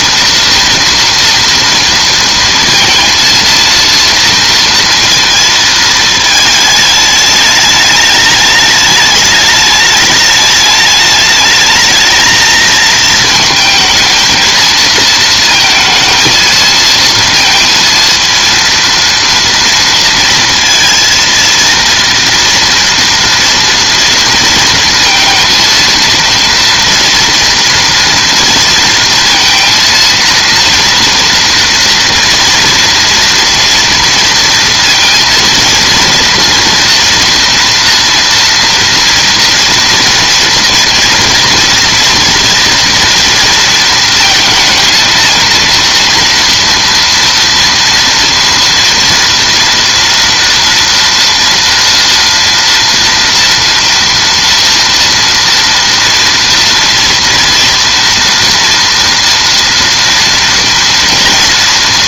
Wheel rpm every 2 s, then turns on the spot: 230, 230, 230, 210, 210, 210, 220, 220, 230, 230, 230, 230, 230, 230, 230, 230, 230, 230, 240, 230, 230, 230, 220, 240, 240, 230, 230, 230, 230, 230, 230.
none